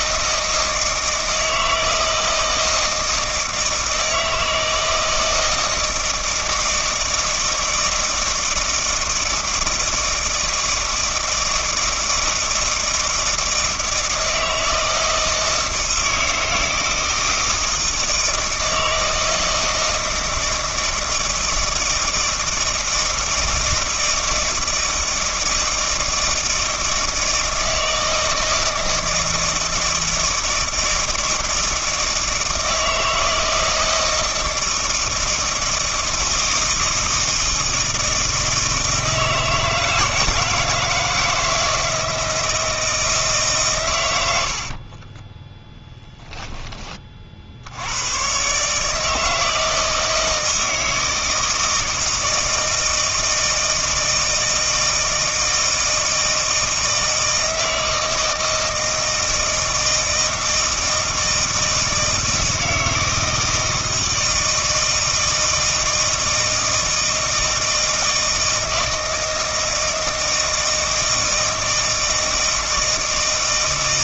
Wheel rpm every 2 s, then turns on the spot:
160, 160, 160, 160, 160, 160, 160, 160, 160, 160, 160, 160, 160, 160, 160, 160, 160, 160, 160, 160, 160, 160, 50, 20, 140, 160, 160, 160, 160, 160, 160, 160, 160, 160, 160, 160, 160.
44-46